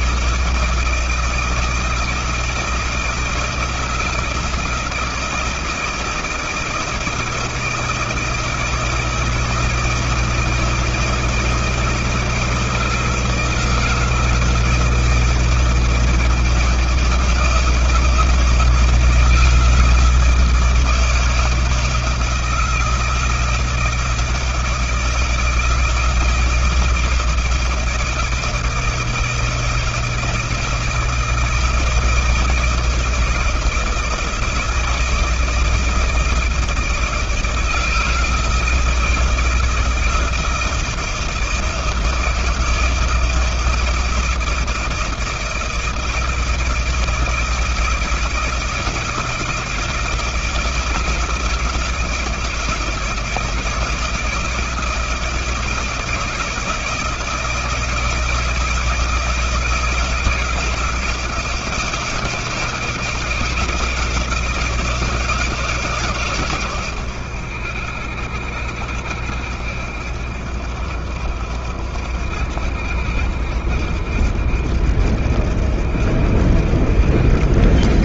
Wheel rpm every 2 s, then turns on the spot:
160, 160, 160, 160, 160, 160, 160, 160, 160, 160, 160, 170, 160, 160, 160, 160, 160, 160, 160, 160, 160, 160, 160, 160, 160, 160, 160, 170, 160, 160, 160, 170, 170, 130, 70, 70, 70, 70, 70.
none